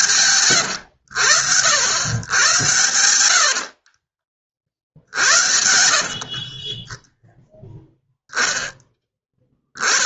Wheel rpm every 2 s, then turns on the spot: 90, 100, 60, 20, 0.
6-8